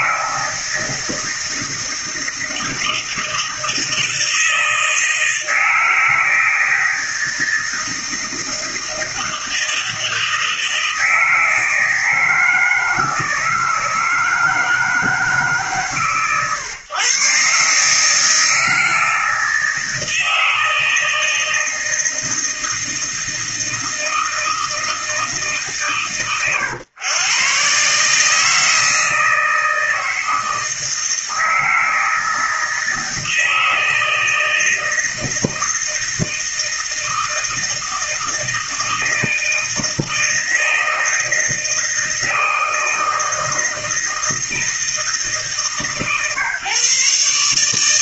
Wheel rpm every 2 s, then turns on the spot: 160, 160, 160, 160, 160, 160, 160, 160, 130, 160, 160, 160, 160, 110, 160, 160, 160, 160, 160, 160, 160, 160, 160, 140.
none